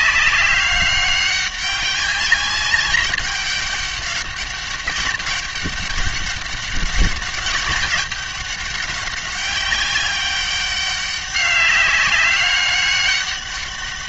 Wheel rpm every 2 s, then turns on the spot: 190, 200, 200, 200, 200, 200, 200.
none